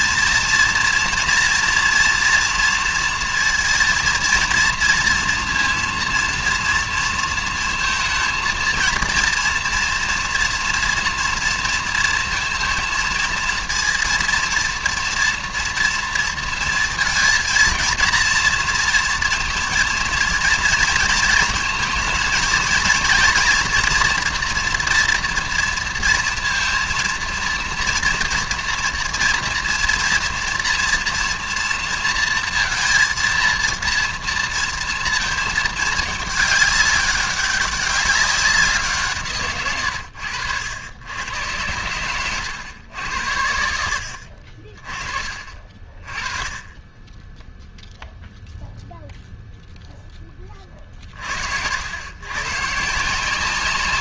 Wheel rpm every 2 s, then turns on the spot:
230, 230, 230, 230, 230, 230, 230, 230, 230, 230, 230, 230, 240, 230, 230, 230, 230, 230, 210, 180, 90, 100, 40, 20, 0, 30, 130.
none